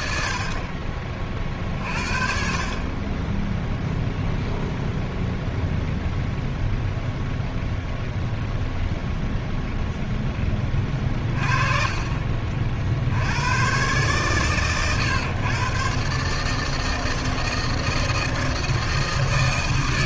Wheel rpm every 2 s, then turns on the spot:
40, 20, 0, 0, 0, 30, 50, 120, 160, 160.
none